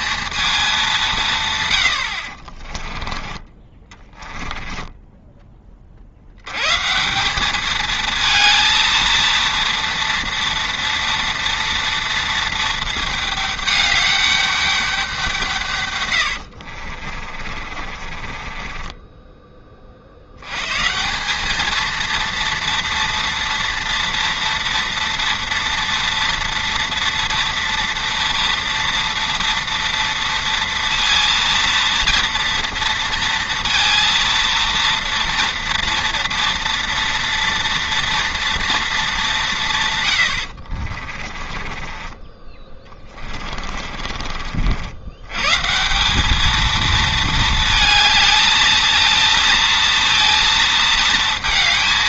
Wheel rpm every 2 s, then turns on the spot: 200, 30, 10, 130, 230, 230, 230, 200, 60, 20, 140, 230, 230, 230, 230, 230, 230, 230, 230, 230, 60, 20, 60, 220, 220, 230.
2-6 16-20 40-44